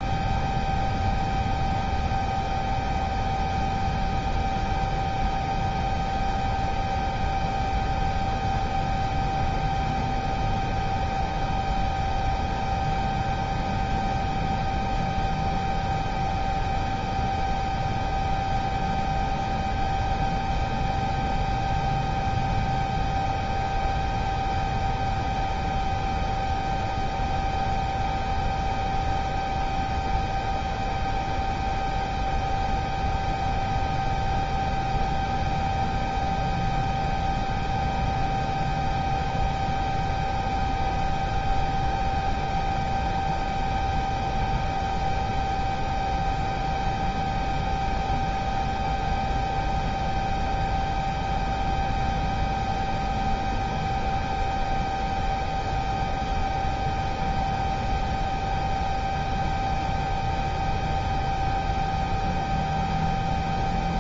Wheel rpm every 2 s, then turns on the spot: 0, 0, 0, 0, 0, 0, 0, 0, 0, 0, 0, 0, 0, 0, 0, 0, 0, 0, 0, 0, 0, 0, 0, 0, 0, 0, 0, 0, 0, 0, 0, 0.
none